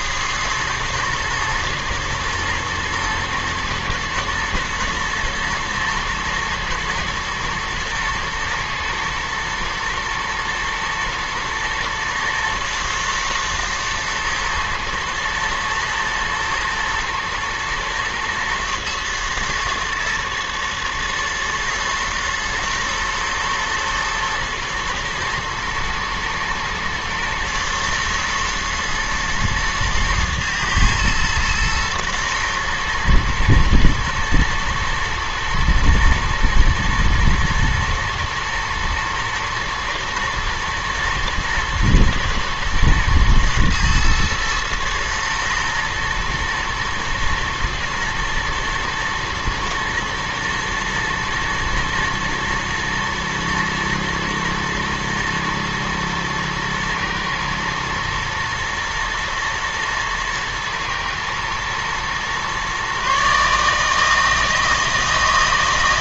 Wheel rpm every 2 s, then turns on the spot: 110, 110, 120, 110, 110, 110, 120, 110, 120, 120, 110, 110, 120, 110, 120, 110, 120, 110, 120, 110, 120, 120, 120, 110, 110, 110, 120, 110, 120, 120, 110, 130, 160.
none